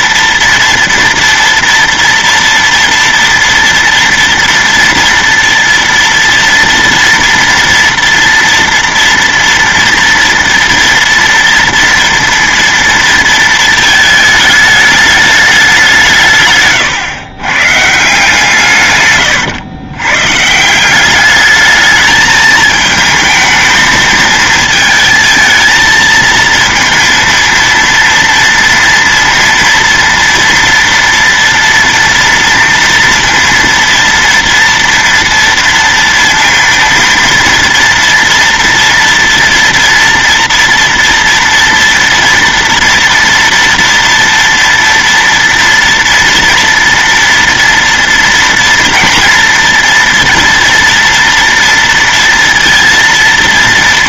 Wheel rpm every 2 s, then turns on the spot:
230, 230, 230, 230, 230, 230, 230, 210, 140, 140, 160, 220, 230, 230, 230, 230, 230, 230, 230, 230, 240, 230, 230, 230, 230, 230, 230.
none